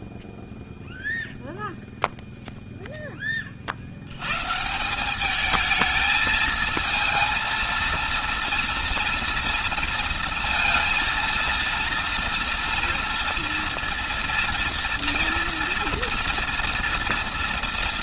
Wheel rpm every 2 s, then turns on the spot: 0, 30, 200, 230, 230, 230, 230, 240, 230.
none